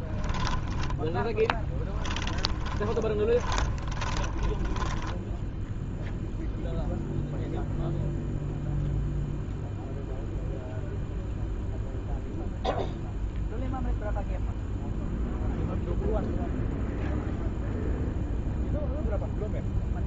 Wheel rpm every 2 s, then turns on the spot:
10, 30, 10, 0, 0, 0, 0, 0, 0, 0.
0-6